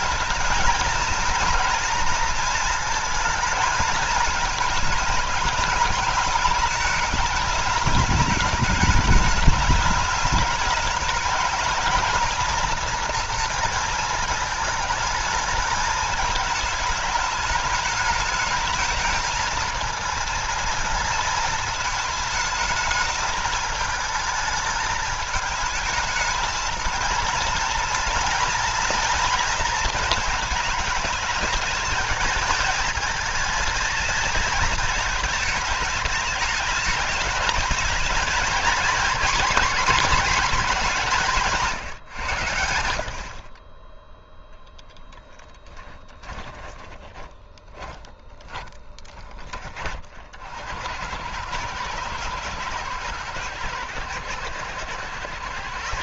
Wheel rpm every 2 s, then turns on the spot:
230, 220, 220, 220, 210, 210, 230, 220, 220, 220, 230, 220, 220, 230, 230, 220, 220, 220, 210, 230, 200, 80, 0, 20, 20, 70, 110, 100.
46-48